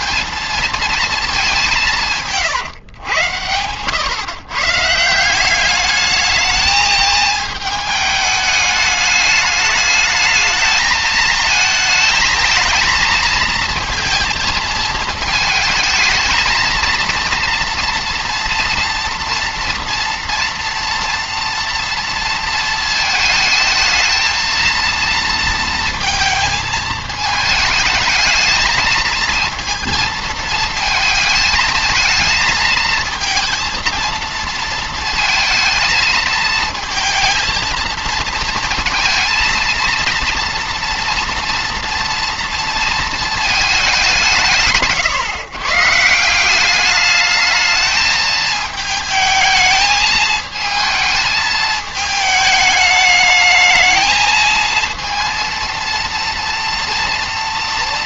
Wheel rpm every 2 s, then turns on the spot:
230, 130, 140, 220, 210, 220, 220, 220, 230, 230, 230, 230, 230, 220, 220, 220, 220, 230, 230, 230, 230, 230, 150, 190, 220, 220, 210, 220, 230.
none